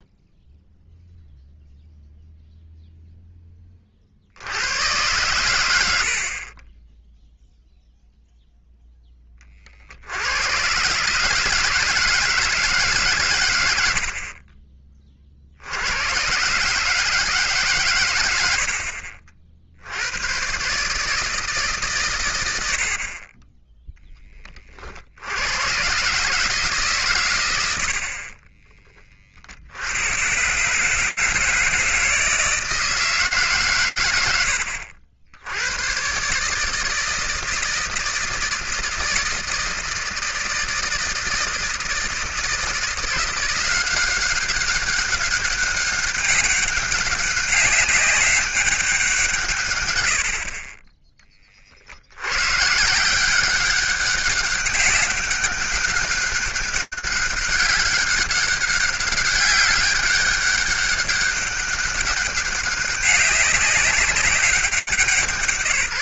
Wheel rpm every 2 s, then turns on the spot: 0, 0, 90, 40, 0, 110, 160, 30, 130, 80, 130, 90, 40, 150, 40, 130, 160, 80, 150, 160, 160, 170, 190, 200, 200, 40, 120, 200, 200, 200, 200, 200, 200.
28-30 50-52